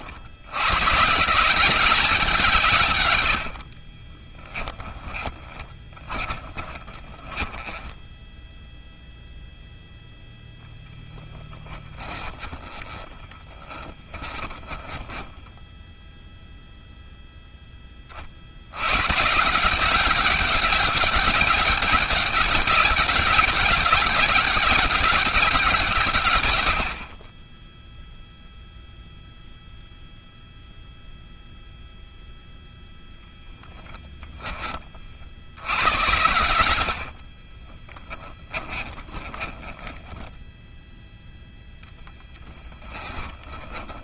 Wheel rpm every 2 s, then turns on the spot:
140, 140, 20, 20, 0, 10, 20, 10, 0, 120, 190, 190, 200, 40, 0, 0, 0, 60, 50, 10, 0, 10.
4-8 10-16 36-40 42-44